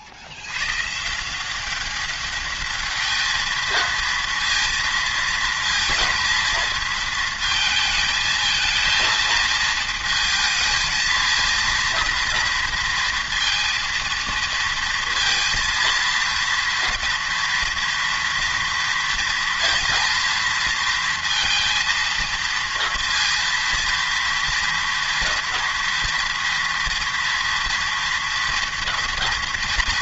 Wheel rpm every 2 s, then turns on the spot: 110, 210, 230, 220, 220, 220, 230, 230, 230, 230, 230, 230, 230, 230, 230.
none